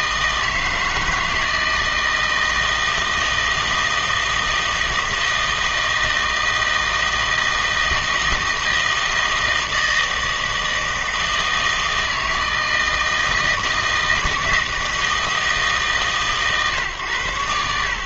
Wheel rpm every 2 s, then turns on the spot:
160, 160, 160, 160, 160, 160, 160, 160, 130.
none